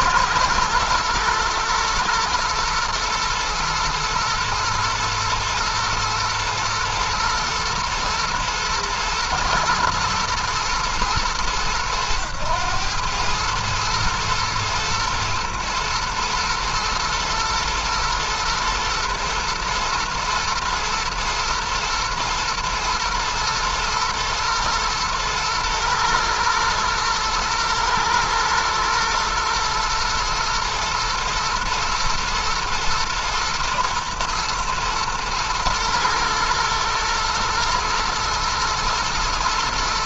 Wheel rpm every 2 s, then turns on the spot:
120, 120, 110, 110, 120, 110, 110, 110, 120, 110, 110, 110, 110, 110, 110, 110, 110, 110, 120, 120.
none